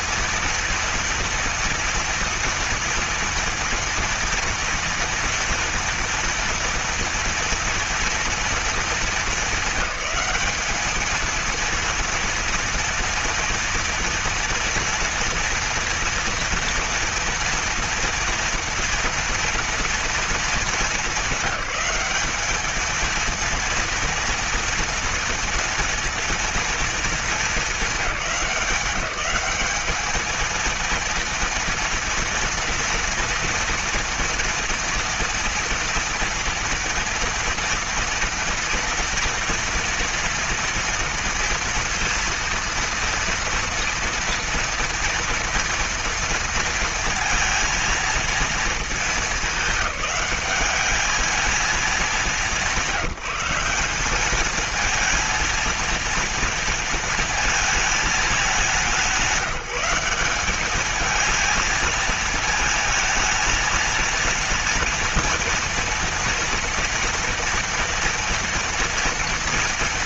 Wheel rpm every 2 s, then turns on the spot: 230, 230, 230, 230, 230, 210, 230, 230, 230, 230, 220, 210, 230, 230, 180, 220, 230, 230, 230, 230, 230, 230, 230, 230, 220, 200, 200, 210, 230, 200, 200, 230, 230, 230, 240.
none